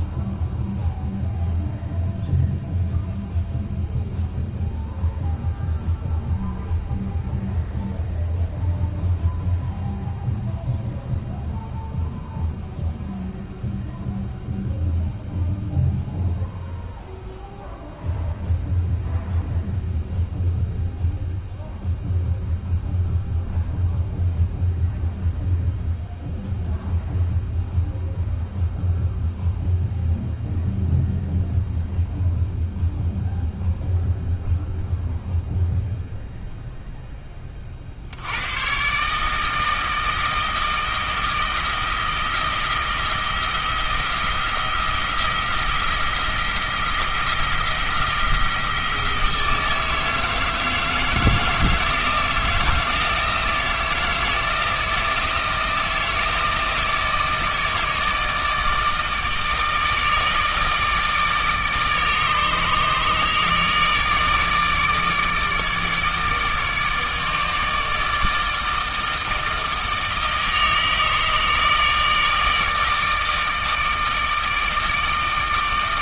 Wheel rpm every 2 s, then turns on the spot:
0, 0, 0, 0, 0, 0, 0, 0, 0, 0, 0, 0, 0, 0, 0, 0, 0, 0, 0, 120, 160, 170, 170, 170, 170, 160, 160, 160, 160, 160, 160, 150, 150, 160, 160, 160, 160, 160.
none